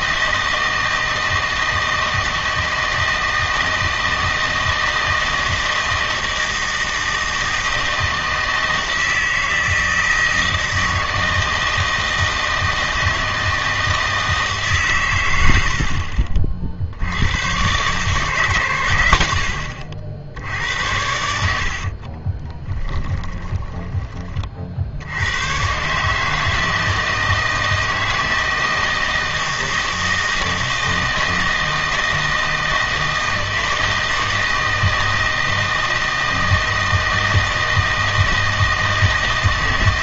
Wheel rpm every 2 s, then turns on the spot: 160, 160, 160, 160, 160, 160, 160, 140, 60, 120, 80, 10, 60, 160, 160, 160, 160, 160, 160, 160.
22-24